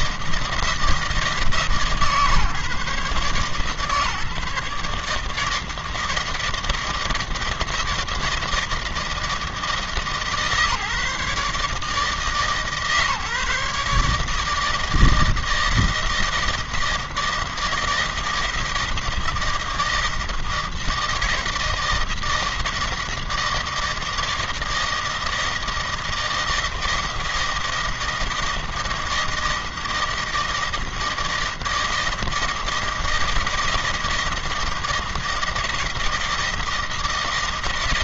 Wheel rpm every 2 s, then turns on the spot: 160, 140, 150, 160, 160, 150, 150, 160, 160, 160, 160, 160, 160, 160, 160, 160, 160, 160, 160.
none